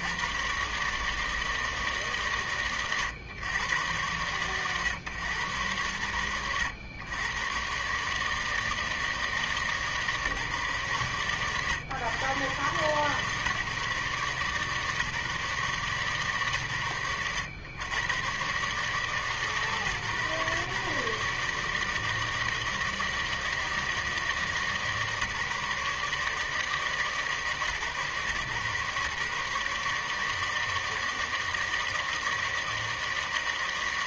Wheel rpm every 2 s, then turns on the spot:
60, 130, 110, 90, 150, 150, 120, 140, 130, 110, 130, 160, 160, 150, 130, 150, 160.
none